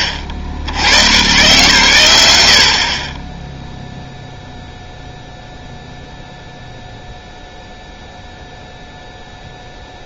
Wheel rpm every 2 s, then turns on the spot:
110, 40, 0, 0, 0.
none